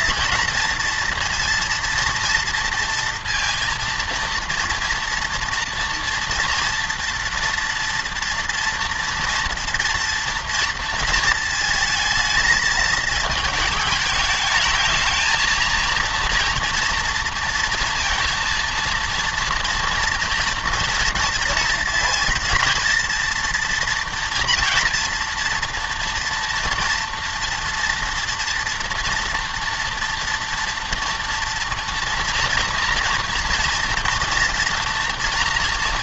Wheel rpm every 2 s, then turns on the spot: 230, 230, 230, 230, 240, 230, 220, 220, 230, 230, 230, 230, 240, 240, 230, 230, 230, 240.
none